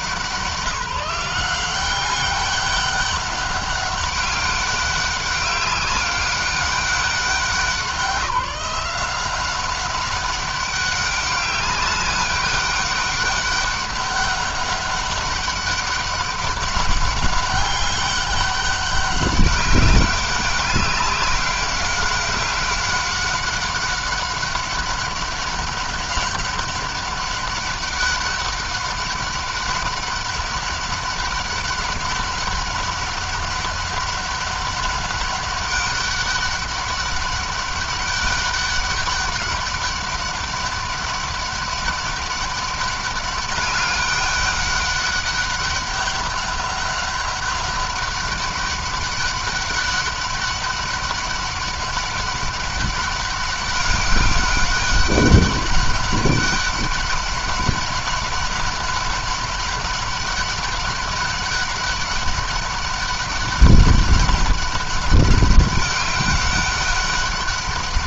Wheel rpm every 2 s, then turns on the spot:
180, 200, 200, 200, 180, 200, 200, 200, 190, 200, 200, 190, 200, 190, 200, 200, 200, 200, 200, 200, 200, 200, 200, 200, 200, 200, 200, 200, 200, 190, 200, 200, 200, 200.
none